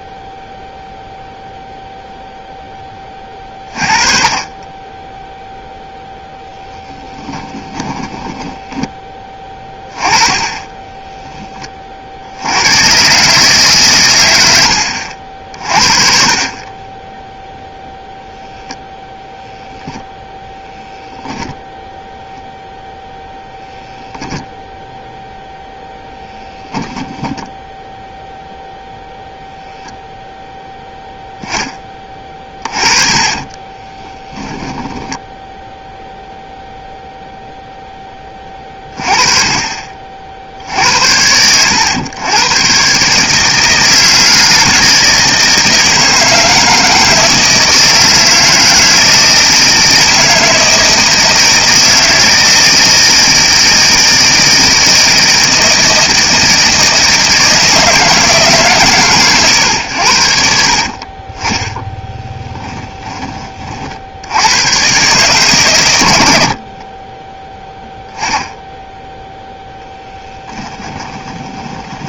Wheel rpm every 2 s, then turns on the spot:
0, 20, 10, 10, 20, 10, 140, 50, 10, 0, 0, 0, 0, 0, 0, 0, 20, 10, 0, 30, 60, 120, 160, 160, 160, 160, 160, 160, 160, 140, 50, 10, 100, 50, 10, 10.
6-8 16-18 32-36 62-64 66-68 70-72